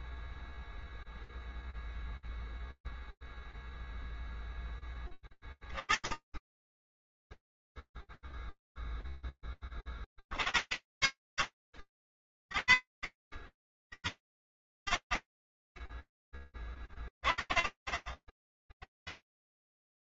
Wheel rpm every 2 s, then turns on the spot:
0, 0, 10, 30, 0, 30, 40, 90, 10, 20.
none